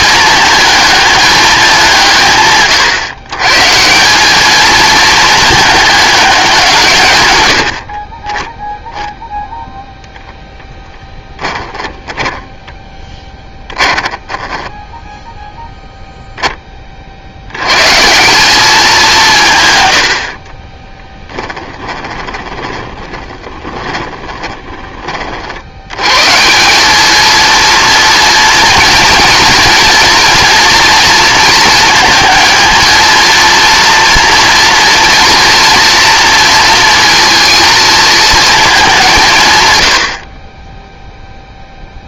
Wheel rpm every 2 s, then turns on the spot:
220, 140, 220, 150, 0, 0, 10, 10, 30, 200, 20, 20, 20, 200, 230, 230, 230, 230, 230, 200, 10.
20-24